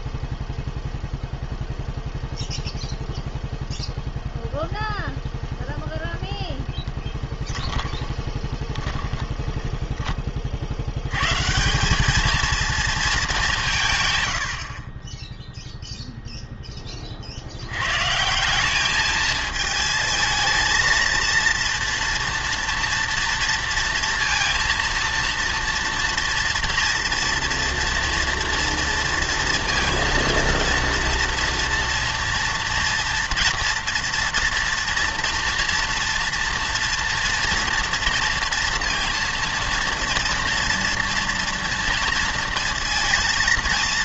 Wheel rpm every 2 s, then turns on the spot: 0, 0, 0, 10, 10, 60, 230, 60, 10, 190, 230, 230, 230, 230, 230, 230, 230, 230, 230, 230, 230, 230.
8-10